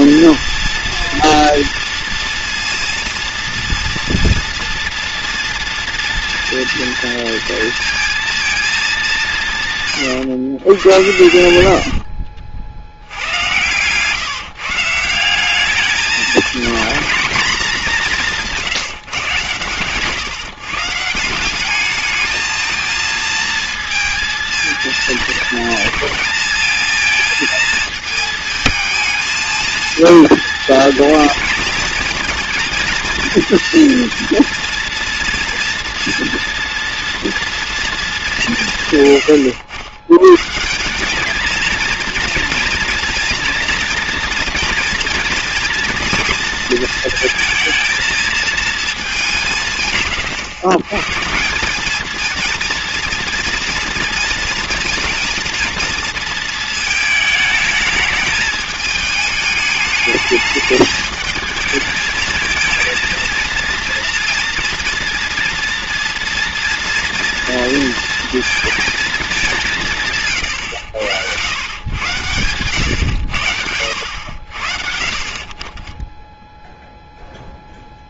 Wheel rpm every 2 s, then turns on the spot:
240, 230, 240, 230, 230, 110, 60, 150, 220, 170, 140, 220, 230, 230, 220, 220, 230, 230, 230, 180, 130, 230, 240, 230, 220, 120, 230, 220, 230, 220, 210, 220, 230, 230, 230, 120, 110, 70, 0.
none